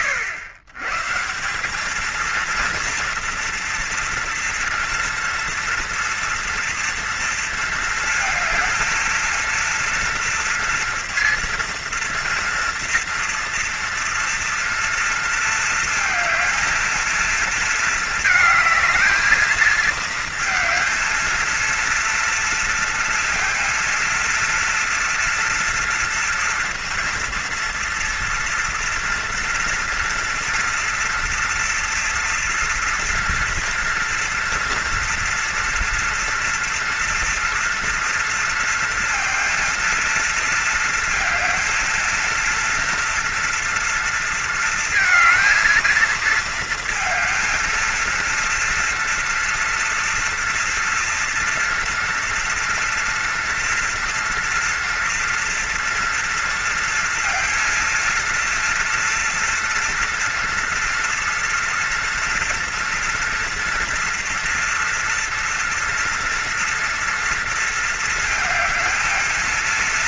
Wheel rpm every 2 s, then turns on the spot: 120, 230, 230, 230, 220, 230, 230, 230, 230, 220, 230, 230, 230, 230, 230, 240, 230, 230, 230, 230, 220, 230, 230, 230, 230, 240, 230, 230, 230, 230, 230, 230, 230, 230, 220.
none